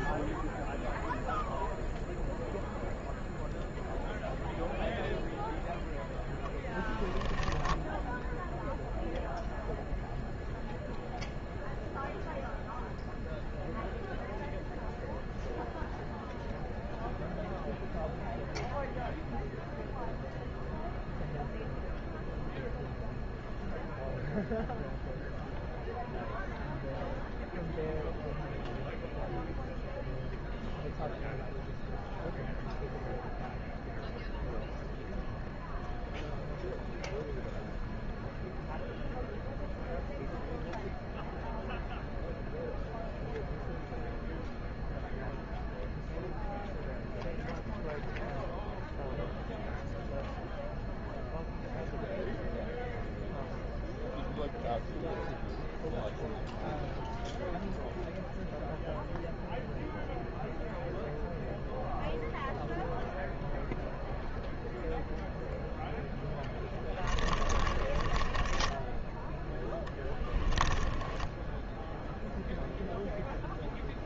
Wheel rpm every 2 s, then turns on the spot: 0, 0, 0, 10, 0, 0, 0, 0, 0, 0, 0, 0, 0, 0, 0, 0, 0, 0, 0, 0, 0, 0, 0, 0, 0, 0, 0, 0, 0, 0, 0, 0, 0, 20, 10, 10, 0.
6-8 66-72